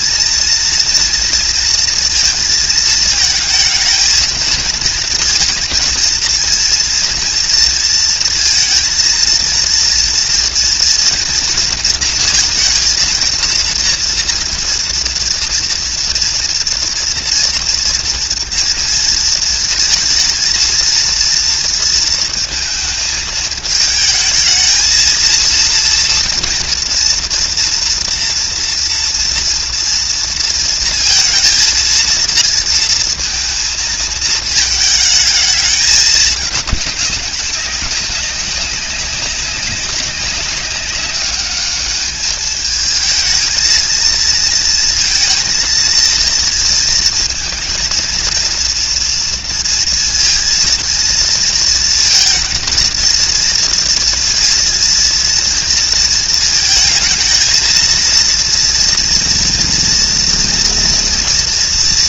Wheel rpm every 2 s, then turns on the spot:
230, 230, 230, 230, 230, 230, 230, 230, 240, 230, 230, 230, 220, 240, 240, 230, 230, 220, 210, 200, 200, 210, 230, 230, 230, 230, 230, 230, 230, 230, 230.
none